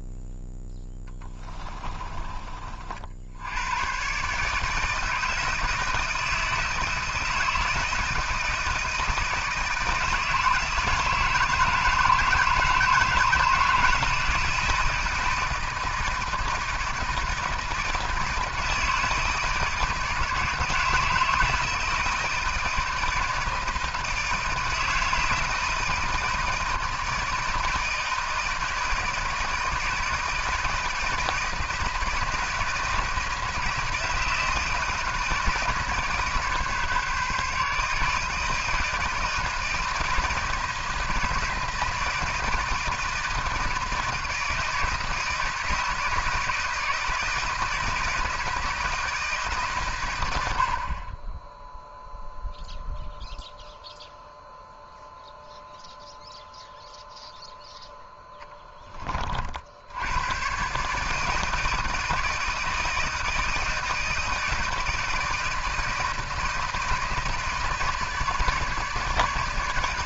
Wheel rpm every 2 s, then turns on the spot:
0, 40, 160, 160, 160, 160, 160, 160, 160, 160, 160, 160, 160, 160, 160, 160, 160, 160, 150, 160, 160, 160, 160, 160, 160, 70, 0, 0, 0, 20, 130, 160, 160, 160, 150.
none